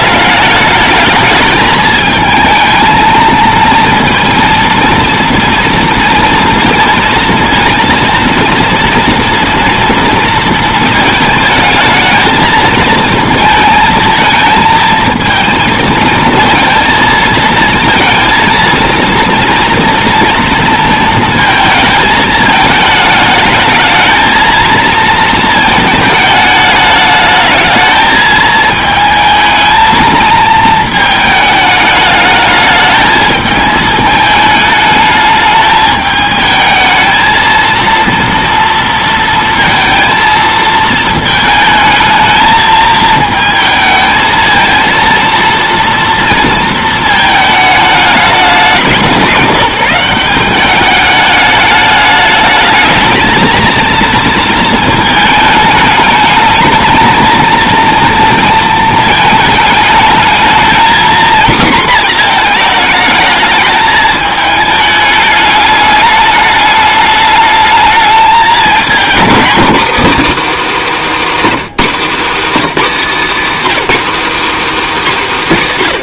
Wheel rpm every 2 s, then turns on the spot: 220, 230, 230, 230, 230, 220, 220, 220, 230, 230, 220, 220, 220, 220, 220, 210, 220, 210, 230, 230, 220, 220, 230, 220, 180, 210, 220, 220, 230, 210, 240, 220, 210, 210, 250, 270, 260, 190.
none